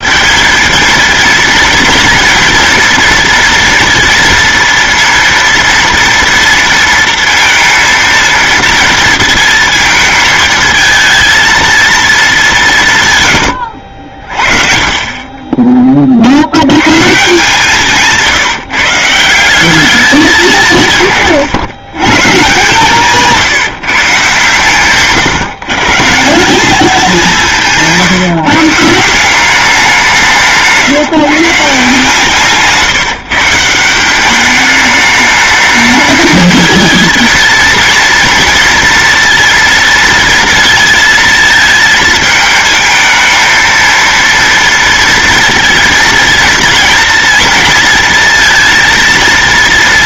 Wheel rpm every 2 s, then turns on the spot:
230, 230, 230, 230, 230, 220, 140, 30, 140, 160, 150, 160, 130, 200, 170, 160, 150, 210, 230, 230, 230, 220, 230, 230, 230.
none